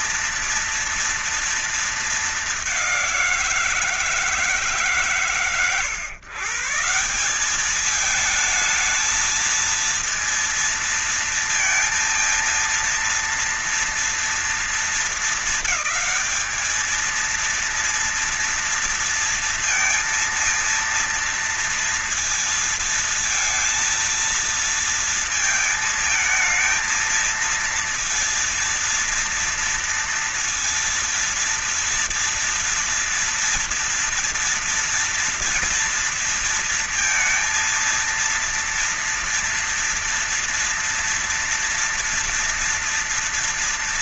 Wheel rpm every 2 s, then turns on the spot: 230, 210, 150, 140, 220, 230, 230, 230, 220, 230, 230, 230, 230, 220, 230, 230, 240, 230, 230, 230, 230, 230.
none